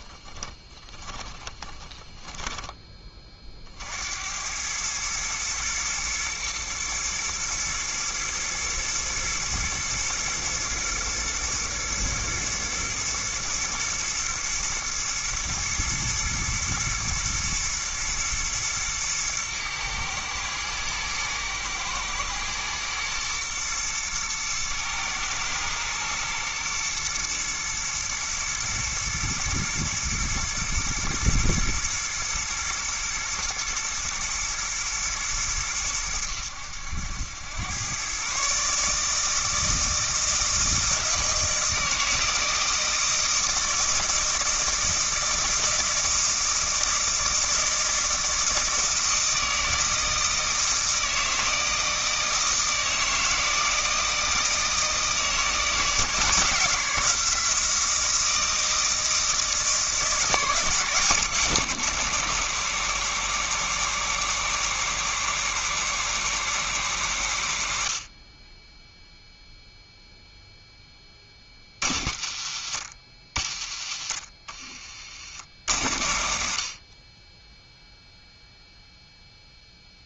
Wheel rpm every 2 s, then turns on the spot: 10, 10, 100, 120, 120, 110, 120, 110, 110, 110, 110, 110, 110, 120, 110, 120, 110, 110, 90, 150, 160, 160, 160, 160, 160, 160, 160, 160, 170, 160, 170, 190, 190, 180, 20, 0, 80, 50, 50, 0.
0-2 74-76